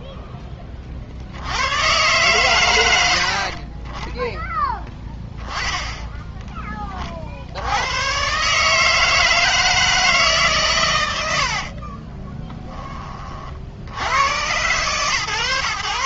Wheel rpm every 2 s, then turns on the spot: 20, 100, 10, 20, 150, 130, 10, 130.
none